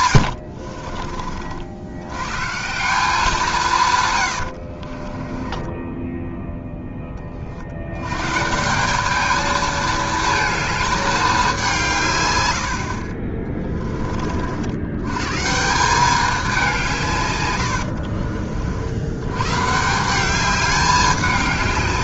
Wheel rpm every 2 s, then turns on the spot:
50, 170, 50, 10, 180, 210, 60, 90, 170, 80, 200.
0-2 4-6 12-14